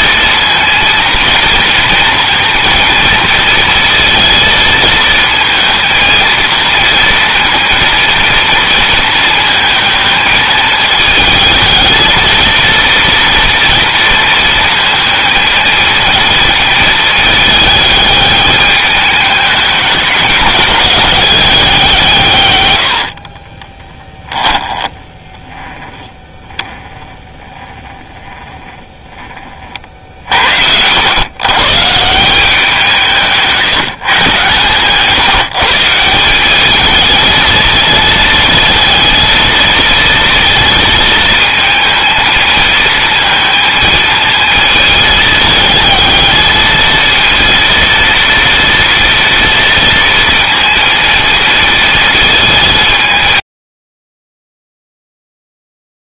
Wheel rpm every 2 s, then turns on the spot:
230, 230, 220, 230, 230, 220, 230, 230, 220, 210, 190, 90, 10, 10, 10, 80, 180, 140, 210, 220, 230, 220, 220, 220, 230, 230, 190, 0.
22-26